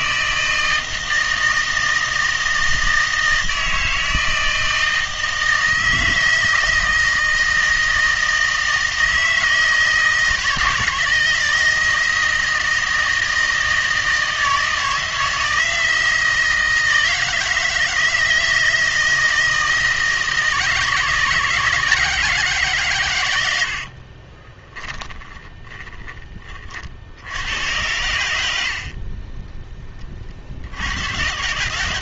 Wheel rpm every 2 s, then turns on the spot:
160, 160, 160, 160, 160, 160, 160, 160, 160, 160, 160, 140, 10, 40, 80, 70.
24-26